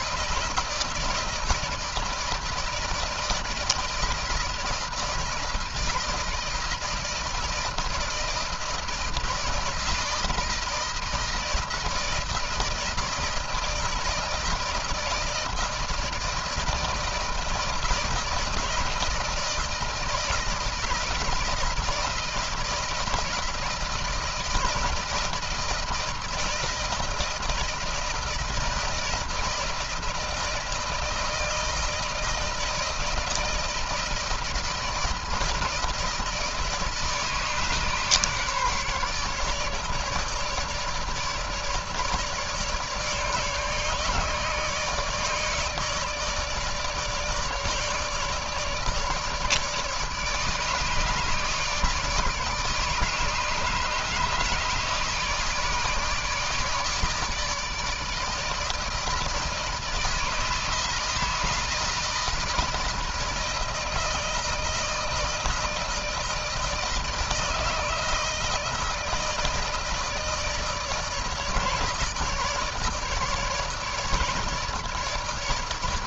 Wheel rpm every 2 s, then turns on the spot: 160, 160, 160, 160, 160, 160, 160, 160, 160, 170, 170, 170, 160, 160, 160, 160, 160, 160, 150, 150, 150, 150, 150, 150, 150, 150, 160, 150, 150, 160, 160, 160, 160, 160, 160, 160, 160, 140.
none